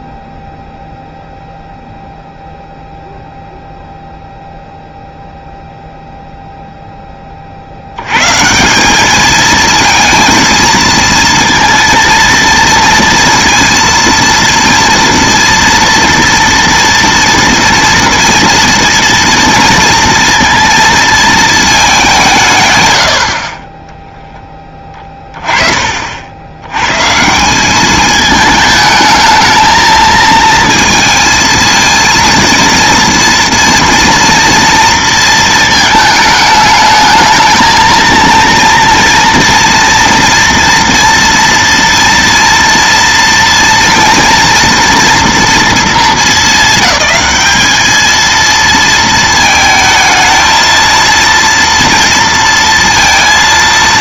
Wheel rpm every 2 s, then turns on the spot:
0, 0, 0, 0, 170, 230, 230, 230, 230, 230, 230, 120, 10, 90, 220, 230, 230, 230, 220, 230, 230, 230, 230, 220, 230, 230, 230.
none